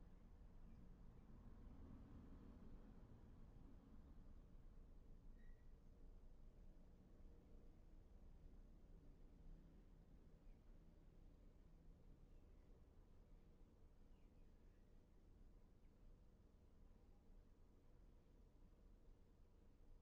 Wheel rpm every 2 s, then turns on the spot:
0, 0, 0, 0, 0, 0, 0, 0, 0, 0.
none